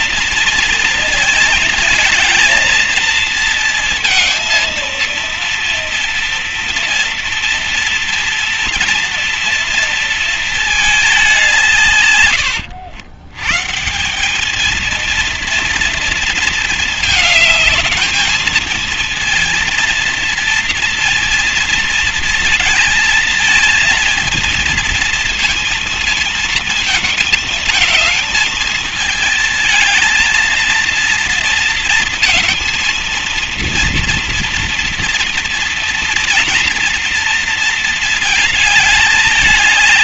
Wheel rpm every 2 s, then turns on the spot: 220, 230, 230, 230, 230, 180, 130, 230, 210, 230, 230, 230, 230, 220, 220, 230, 230, 230, 230, 210.
none